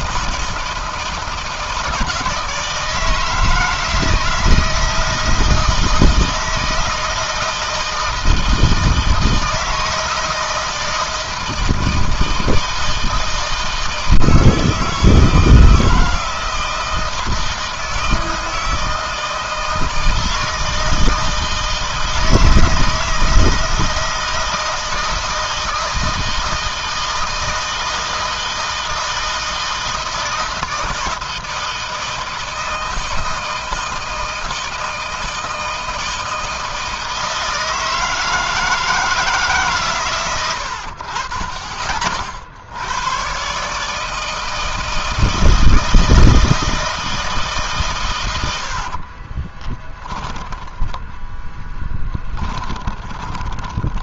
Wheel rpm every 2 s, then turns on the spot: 160, 160, 160, 160, 160, 160, 160, 160, 160, 160, 160, 160, 160, 160, 160, 160, 160, 160, 160, 160, 80, 90, 160, 160, 60, 20, 20.
48-54